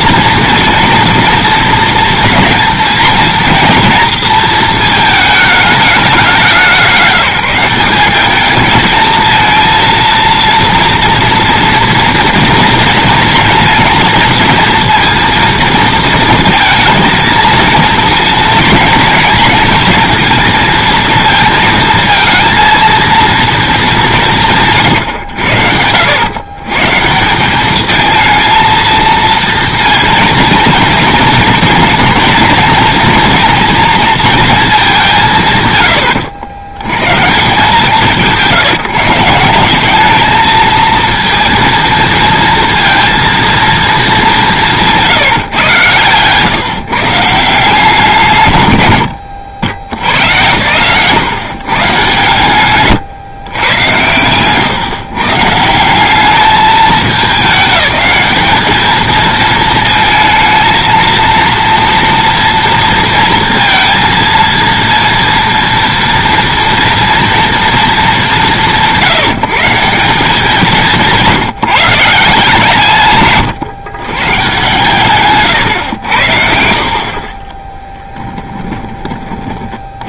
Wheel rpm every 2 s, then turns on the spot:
230, 230, 220, 180, 210, 230, 230, 230, 220, 230, 230, 230, 140, 140, 230, 230, 220, 210, 100, 170, 230, 230, 170, 140, 100, 120, 120, 130, 210, 210, 220, 230, 230, 230, 160, 190, 160, 130, 70, 20.
50-54 78-80